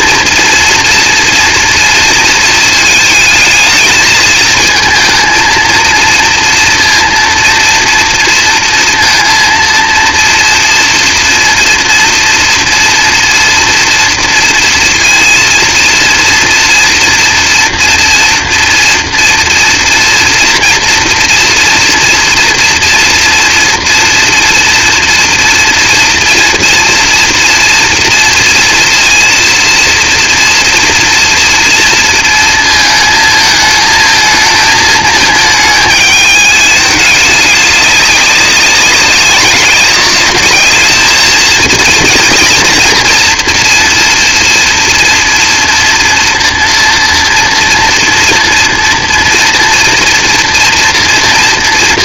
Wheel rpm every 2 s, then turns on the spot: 230, 220, 230, 230, 230, 230, 240, 230, 230, 230, 230, 240, 230, 230, 230, 230, 230, 220, 210, 190, 210, 230, 230, 230, 230, 240.
none